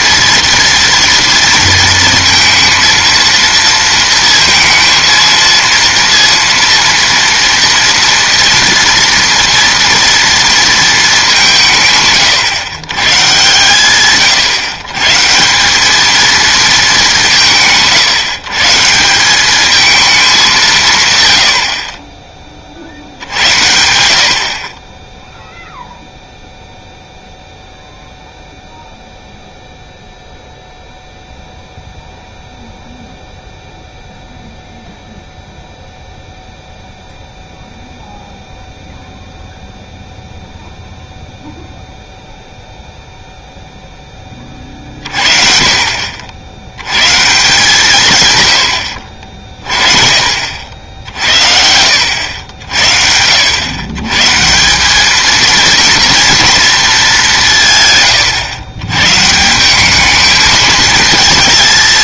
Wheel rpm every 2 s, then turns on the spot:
230, 230, 230, 230, 230, 230, 130, 130, 220, 150, 170, 60, 40, 0, 0, 0, 0, 0, 0, 0, 0, 0, 40, 100, 90, 60, 70, 170, 220, 110, 220.
none